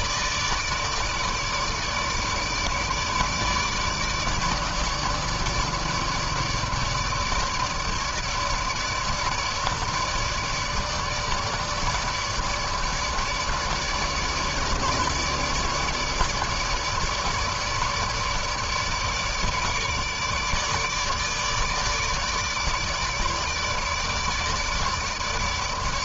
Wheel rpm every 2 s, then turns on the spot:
150, 150, 150, 150, 150, 150, 150, 150, 150, 150, 150, 150, 150.
none